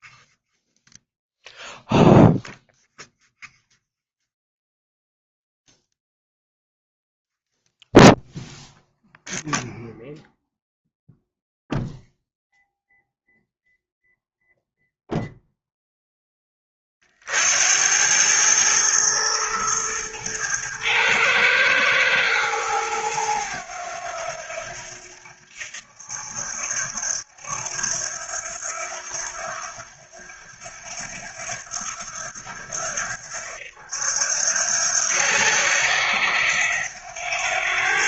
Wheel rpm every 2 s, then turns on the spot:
0, 0, 0, 0, 0, 0, 0, 0, 40, 110, 110, 100, 80, 80, 80, 80, 80, 80, 90.
none